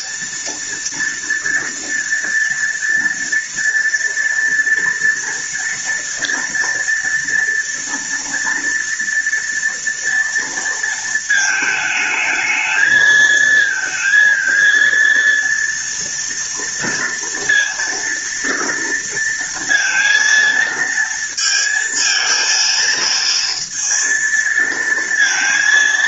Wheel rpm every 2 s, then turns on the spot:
230, 230, 230, 230, 230, 230, 220, 230, 230, 230, 230, 230, 230.
none